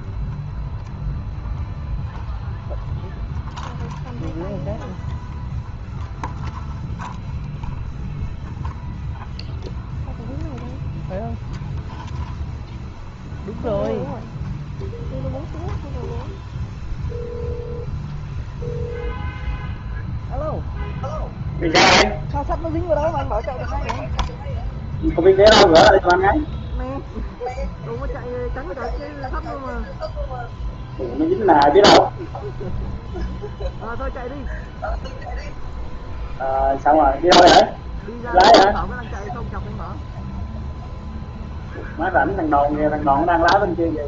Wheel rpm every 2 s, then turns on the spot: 0, 0, 0, 0, 0, 0, 0, 0, 0, 0, 0, 0, 0, 0, 0, 0, 0, 0, 0, 0, 0, 0.
none